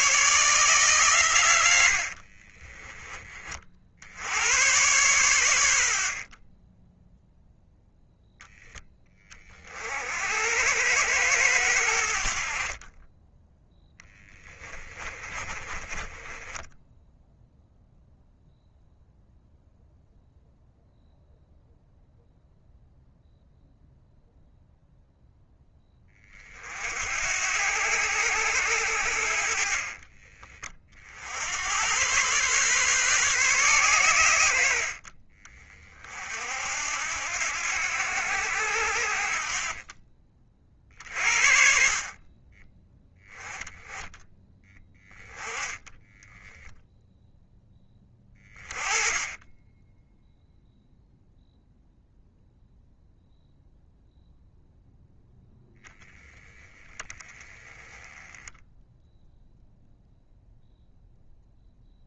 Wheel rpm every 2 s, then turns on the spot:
120, 20, 110, 0, 30, 100, 20, 30, 0, 0, 0, 0, 0, 60, 80, 60, 130, 50, 70, 60, 60, 10, 10, 0, 30, 0, 0, 0, 10, 0, 0.
12-16